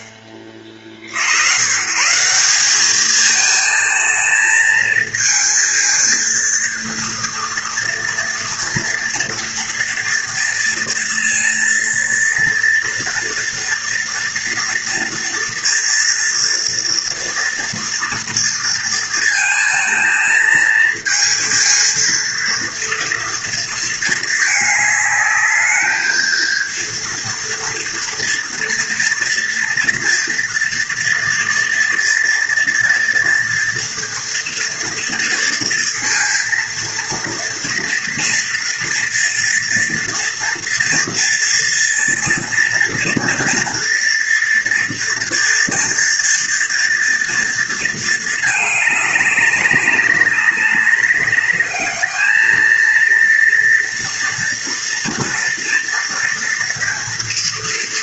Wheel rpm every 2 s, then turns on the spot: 40, 210, 220, 230, 230, 230, 230, 230, 230, 230, 220, 230, 210, 230, 230, 230, 230, 230, 230, 230, 230, 230, 230, 230, 210, 200, 230, 230, 230.
none